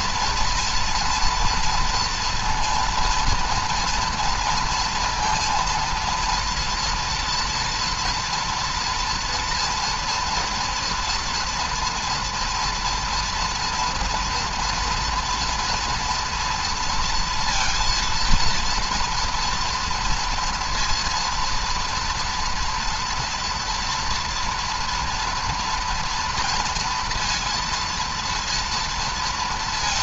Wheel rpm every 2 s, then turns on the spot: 230, 230, 230, 240, 240, 230, 230, 230, 230, 230, 230, 230, 230, 230, 230.
none